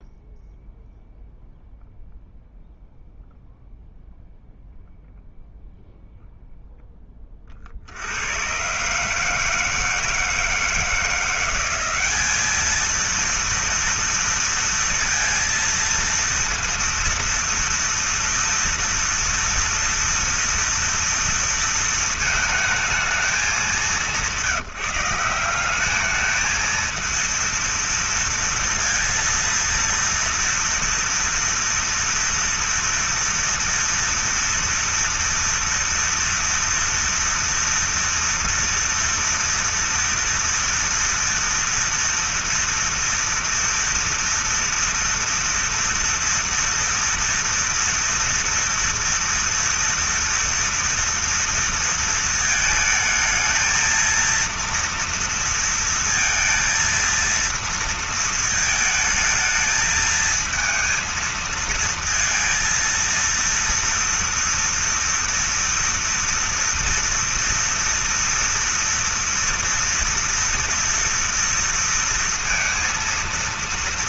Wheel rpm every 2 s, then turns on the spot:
0, 0, 0, 0, 130, 160, 220, 230, 230, 240, 230, 220, 180, 230, 230, 230, 230, 230, 230, 230, 240, 240, 230, 230, 230, 230, 220, 230, 230, 220, 230, 230, 230, 240, 230, 230, 230.
none